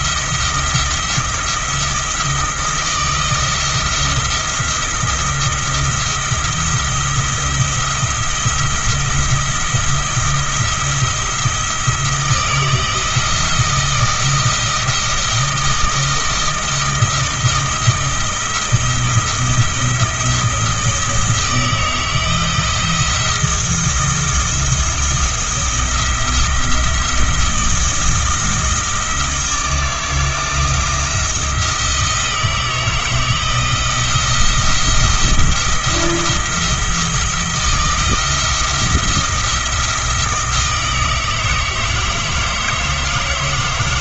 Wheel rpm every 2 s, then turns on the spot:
170, 160, 170, 170, 170, 170, 170, 160, 160, 170, 160, 160, 170, 170, 160, 170, 160, 170, 170, 170, 160, 160.
none